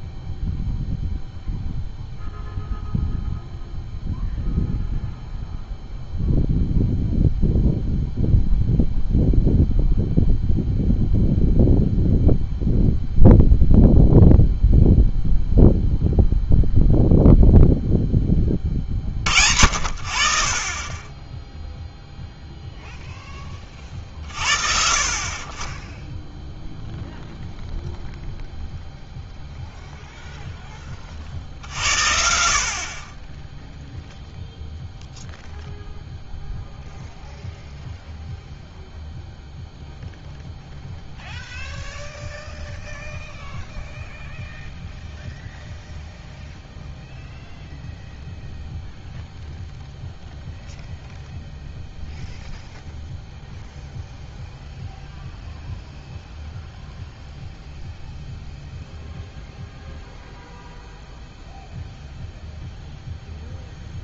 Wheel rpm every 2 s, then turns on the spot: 0, 0, 0, 0, 0, 0, 0, 0, 0, 30, 30, 0, 60, 0, 0, 20, 60, 0, 0, 0, 0, 0, 0, 0, 0, 0, 0, 0, 0, 0, 0, 0.
none